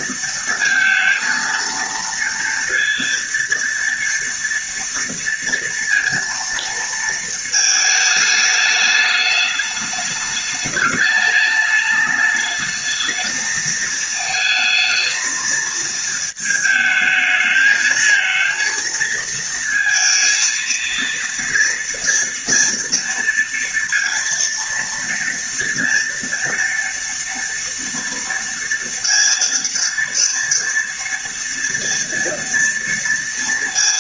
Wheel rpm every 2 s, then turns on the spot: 230, 230, 230, 230, 210, 210, 220, 230, 220, 230, 230, 230, 230, 230, 230, 230, 230.
none